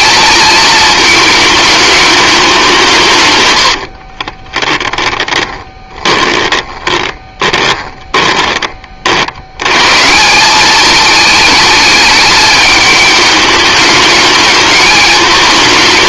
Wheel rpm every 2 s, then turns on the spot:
220, 170, 20, 20, 40, 210, 210, 220.
4-8